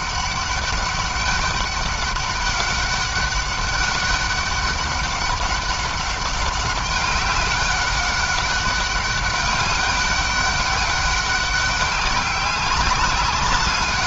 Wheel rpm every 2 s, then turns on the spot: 200, 200, 200, 190, 200, 200, 200.
none